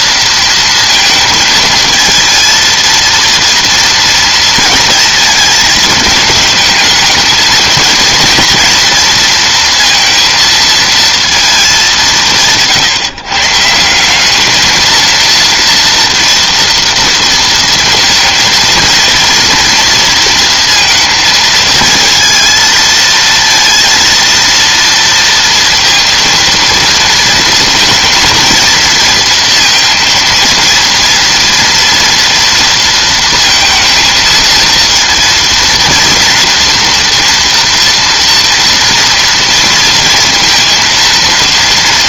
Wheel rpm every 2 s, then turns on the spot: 230, 230, 230, 220, 230, 230, 150, 220, 230, 230, 230, 230, 230, 230, 220, 230, 230, 230, 230, 230, 230.
none